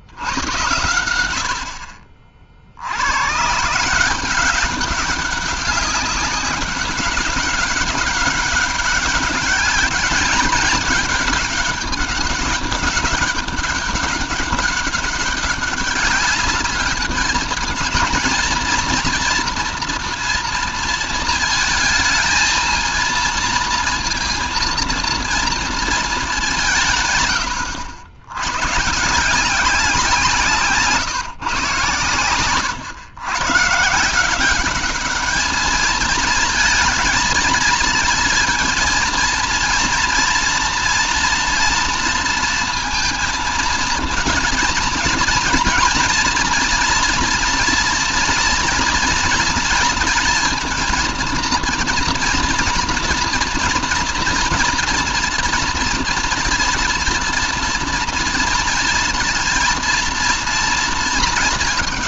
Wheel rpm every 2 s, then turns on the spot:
90, 70, 190, 200, 200, 210, 200, 200, 200, 230, 230, 230, 230, 160, 120, 160, 140, 200, 230, 230, 230, 230, 230, 230, 240, 230, 230, 230, 240, 230, 230.
none